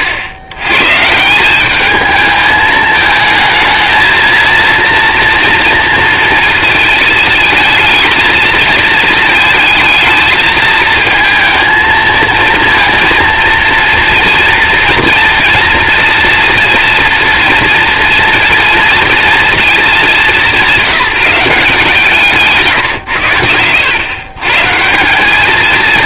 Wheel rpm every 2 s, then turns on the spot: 120, 220, 230, 220, 230, 220, 230, 230, 240, 230, 160, 140, 150.
none